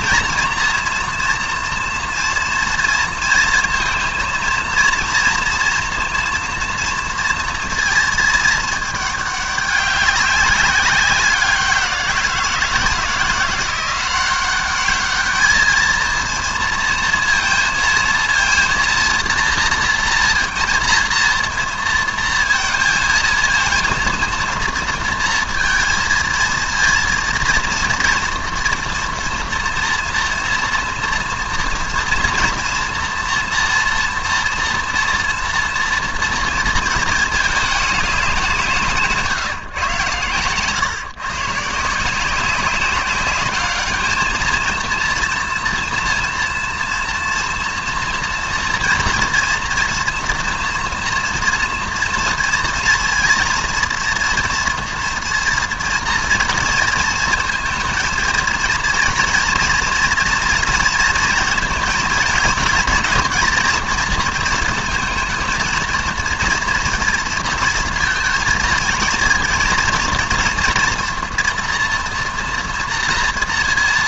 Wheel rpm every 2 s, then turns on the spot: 230, 230, 230, 230, 210, 200, 170, 200, 230, 230, 230, 230, 230, 230, 230, 230, 240, 240, 230, 180, 120, 190, 230, 230, 230, 240, 230, 230, 230, 230, 230, 230, 230, 230, 230, 230, 230.
none